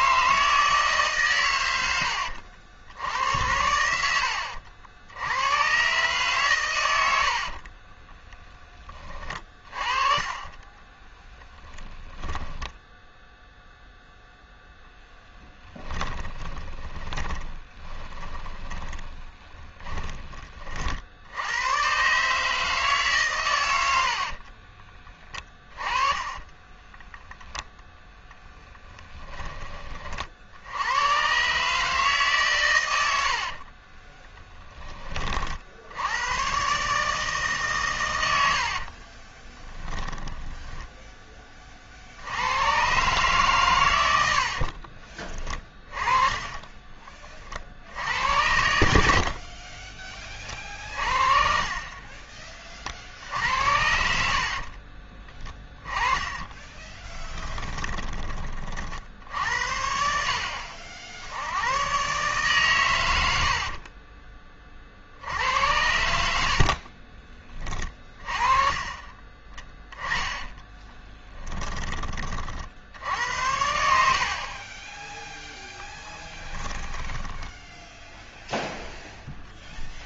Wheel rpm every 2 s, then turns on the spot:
150, 70, 70, 100, 20, 10, 10, 0, 20, 30, 40, 150, 30, 10, 10, 90, 100, 20, 130, 60, 10, 120, 40, 20, 80, 50, 50, 40, 20, 50, 70, 100, 60, 50, 30, 10, 60, 30, 20, 0.
10-12 16-20 24-28 38-42 44-46 48-52 54-58 66-72 76-78